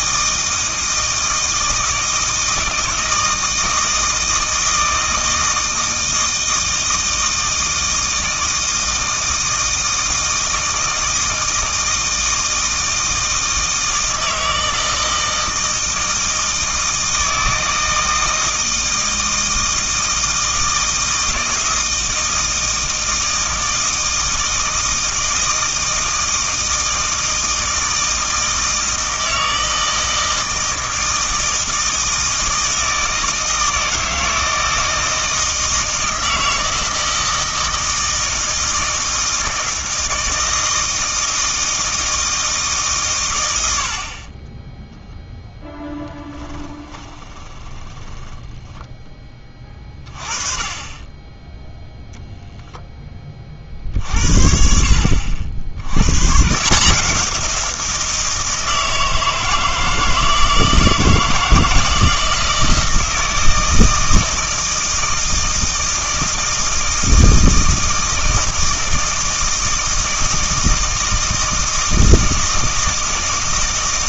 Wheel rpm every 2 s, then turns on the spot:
160, 160, 160, 160, 160, 160, 160, 160, 160, 160, 160, 160, 160, 160, 160, 160, 160, 160, 160, 160, 160, 150, 0, 10, 10, 20, 0, 60, 160, 160, 160, 160, 160, 160, 160, 160, 160.
46-48